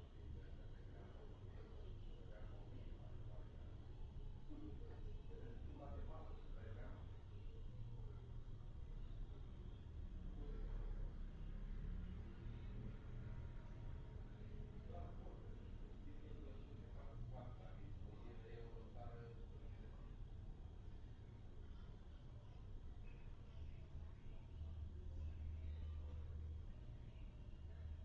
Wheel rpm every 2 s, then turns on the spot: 0, 0, 0, 0, 0, 0, 0, 0, 0, 0, 0, 0, 0, 0.
none